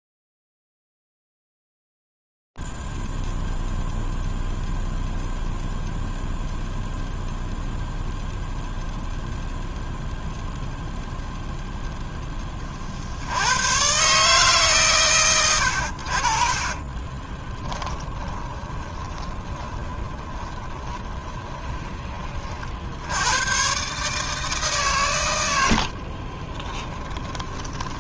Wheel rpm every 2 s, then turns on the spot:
0, 0, 0, 0, 0, 0, 0, 140, 60, 10, 20, 60, 140, 20.
18-22 26-28